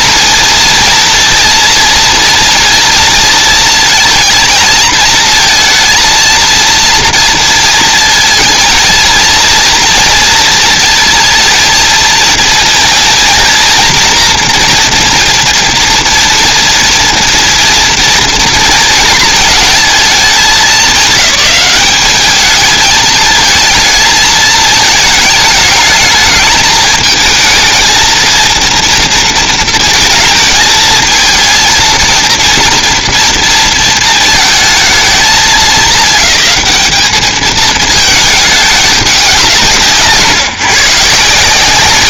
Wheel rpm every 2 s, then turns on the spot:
230, 240, 230, 230, 230, 230, 230, 230, 230, 220, 200, 220, 220, 220, 230, 220, 230, 220, 190, 210, 140.
none